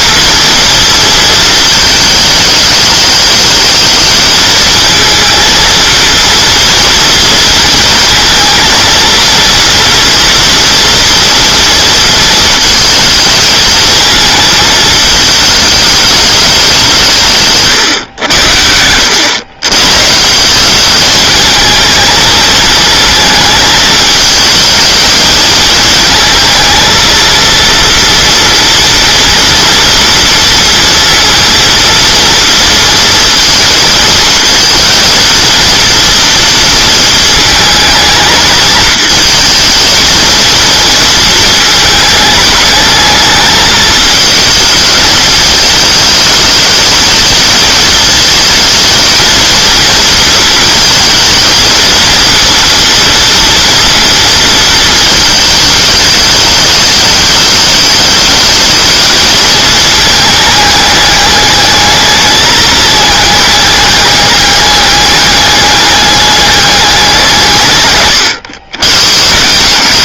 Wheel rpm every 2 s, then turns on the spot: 230, 210, 220, 230, 230, 240, 220, 230, 180, 80, 200, 220, 220, 220, 230, 230, 230, 230, 230, 220, 230, 220, 220, 220, 220, 220, 230, 230, 210, 220, 210, 210, 200, 200, 100.
none